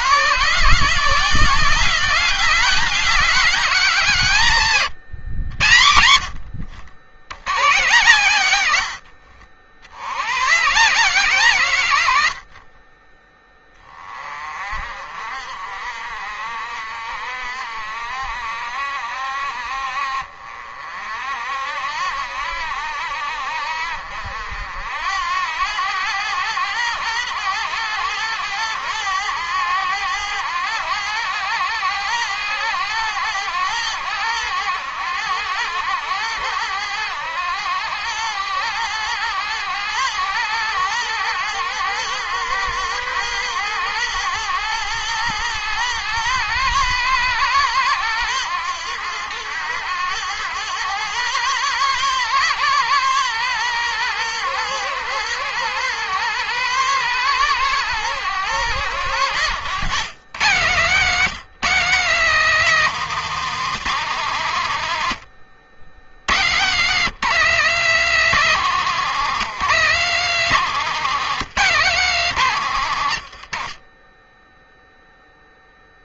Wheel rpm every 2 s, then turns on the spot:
170, 200, 140, 80, 80, 140, 30, 50, 60, 60, 50, 70, 80, 100, 100, 100, 100, 100, 100, 100, 110, 110, 110, 110, 100, 110, 120, 120, 120, 130, 160, 200, 120, 140, 190, 180, 120, 0.
12-14 64-66